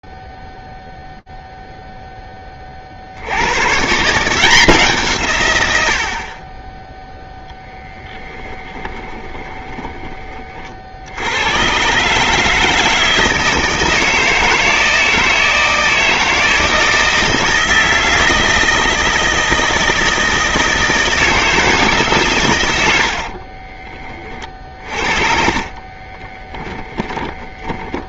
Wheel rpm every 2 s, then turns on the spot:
0, 20, 160, 40, 10, 70, 160, 160, 160, 160, 160, 100, 50, 30.
8-10 22-28